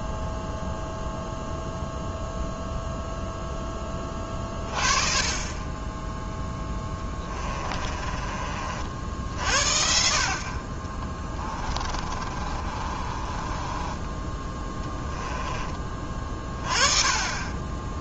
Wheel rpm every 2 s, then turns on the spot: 0, 0, 20, 10, 60, 40, 30, 10, 30.
6-8 12-16